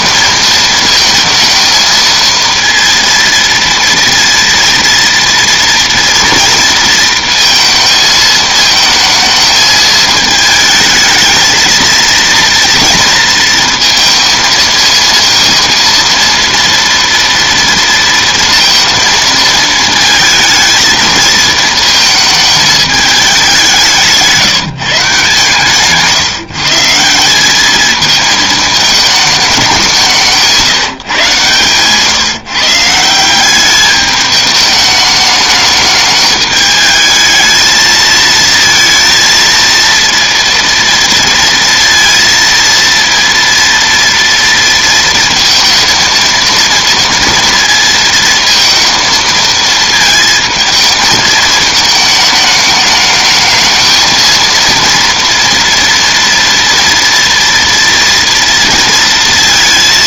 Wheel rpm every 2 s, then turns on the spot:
220, 230, 230, 230, 220, 220, 230, 230, 230, 230, 220, 220, 160, 150, 220, 170, 150, 210, 210, 230, 230, 230, 230, 230, 230, 220, 210, 230, 230, 230.
none